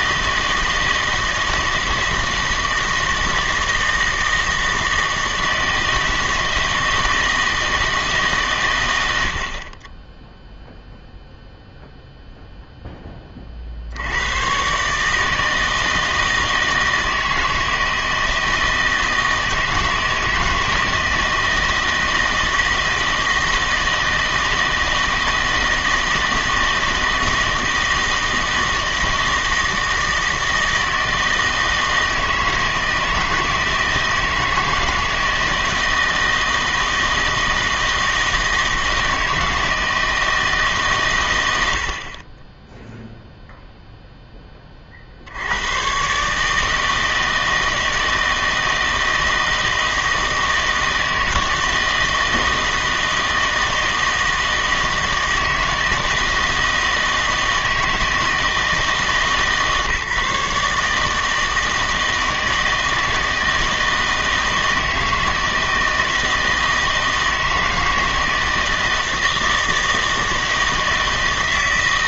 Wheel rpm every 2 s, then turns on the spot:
160, 160, 160, 160, 120, 0, 0, 130, 160, 160, 160, 160, 160, 160, 160, 160, 160, 160, 160, 160, 150, 20, 20, 150, 160, 160, 160, 160, 160, 160, 150, 160, 160, 160, 160, 160.
none